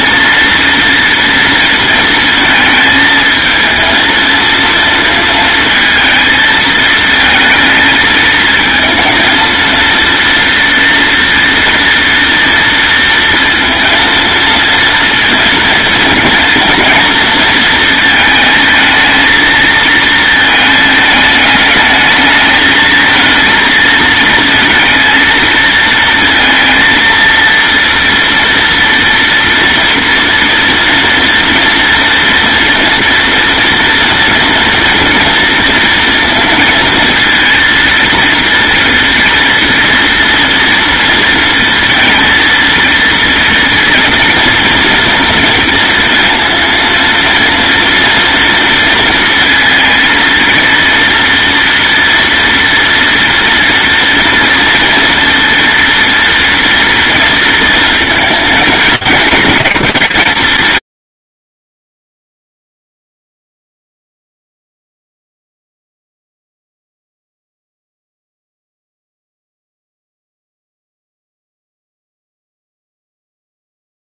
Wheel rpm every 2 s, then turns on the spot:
230, 220, 230, 220, 230, 230, 230, 230, 230, 220, 220, 220, 230, 230, 230, 230, 230, 230, 230, 230, 230, 230, 240, 230, 230, 230, 240, 230, 230, 220, 110, 0, 0, 0, 0, 0, 0.
none